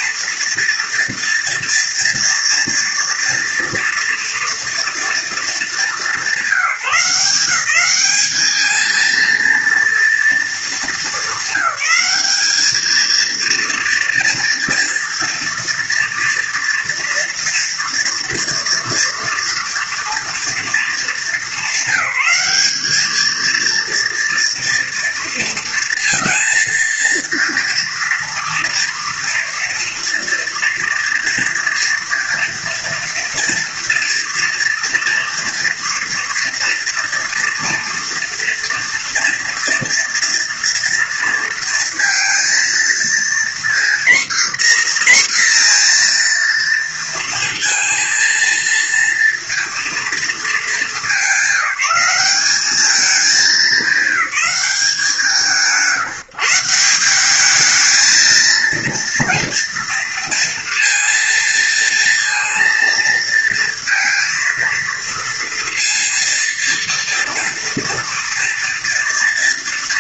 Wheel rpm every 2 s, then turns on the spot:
230, 240, 230, 190, 220, 230, 220, 240, 240, 230, 220, 200, 230, 230, 230, 240, 240, 240, 230, 230, 240, 230, 260, 230, 230, 210, 210, 200, 170, 230, 230, 230, 230, 230, 230.
none